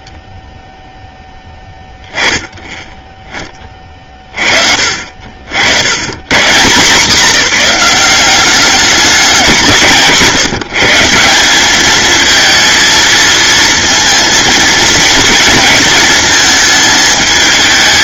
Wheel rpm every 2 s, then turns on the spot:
0, 10, 50, 160, 200, 160, 230, 230, 220.
none